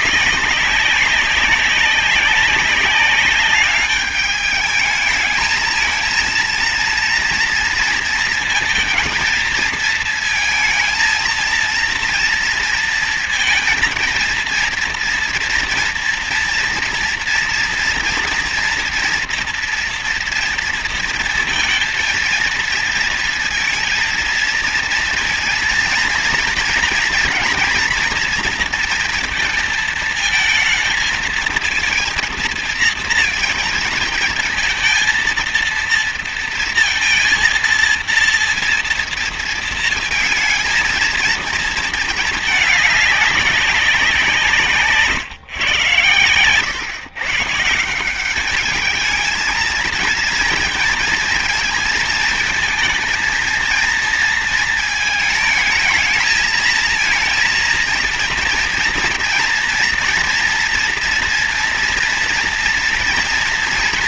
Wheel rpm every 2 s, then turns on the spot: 190, 190, 210, 230, 230, 230, 230, 230, 240, 230, 230, 230, 230, 230, 240, 220, 230, 230, 230, 230, 230, 220, 170, 110, 190, 230, 230, 230, 220, 230, 230, 230.
none